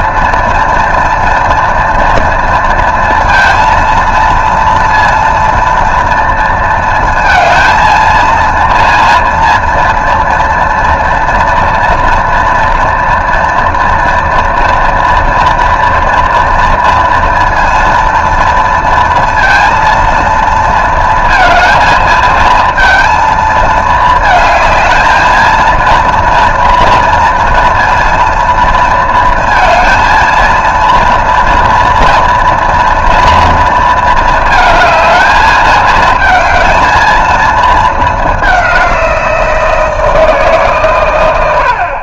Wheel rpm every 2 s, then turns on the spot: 230, 230, 230, 230, 230, 230, 230, 230, 230, 230, 230, 230, 220, 230, 230, 220, 230, 220, 220, 210, 160.
none